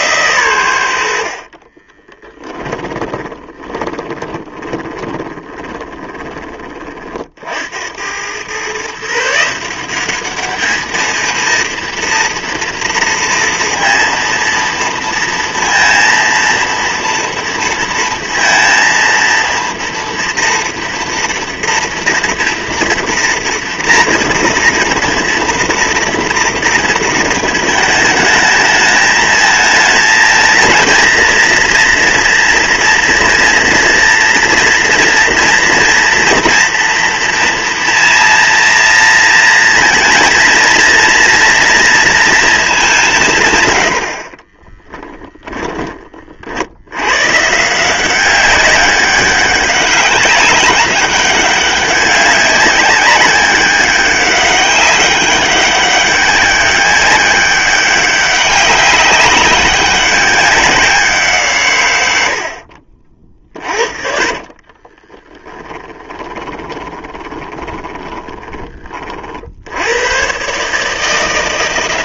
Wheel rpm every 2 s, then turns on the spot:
80, 10, 20, 40, 140, 220, 230, 230, 230, 230, 240, 230, 230, 230, 220, 220, 230, 230, 230, 230, 230, 200, 10, 90, 200, 200, 200, 200, 200, 190, 180, 50, 20, 20, 30, 150.
2-6 44-46 64-68